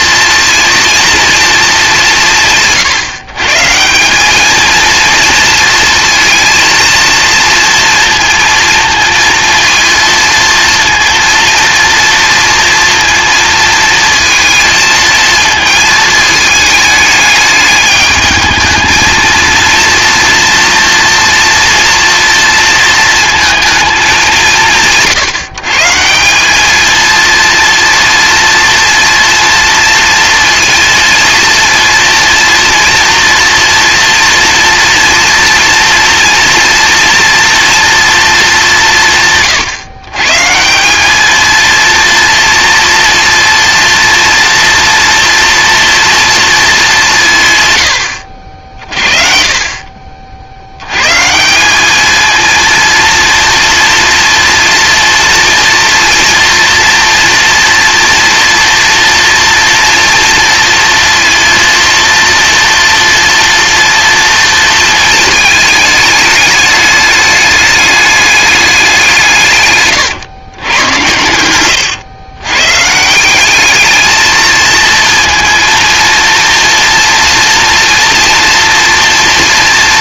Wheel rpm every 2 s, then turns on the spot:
230, 170, 220, 230, 230, 230, 230, 230, 220, 220, 230, 230, 180, 210, 230, 230, 230, 240, 230, 200, 170, 230, 230, 210, 60, 100, 230, 230, 230, 240, 230, 240, 230, 210, 190, 110, 140, 220, 230, 230.
none